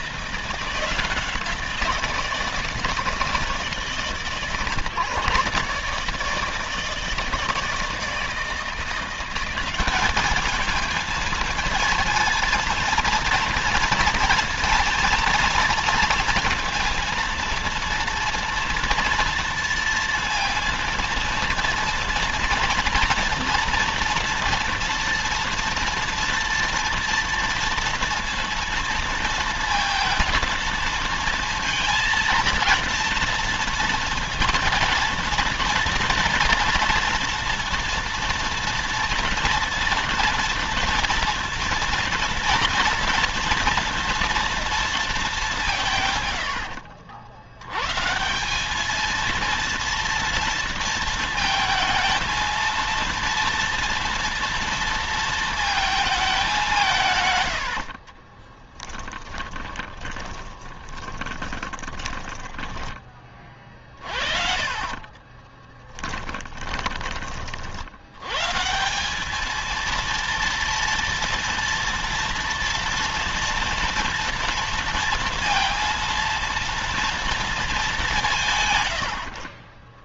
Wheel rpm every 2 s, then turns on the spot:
170, 160, 140, 160, 170, 220, 230, 230, 230, 240, 230, 230, 230, 230, 230, 230, 230, 230, 240, 230, 230, 230, 230, 80, 210, 230, 230, 230, 170, 20, 10, 20, 40, 20, 170, 230, 230, 230, 230, 120.
46-48 58-62 64-68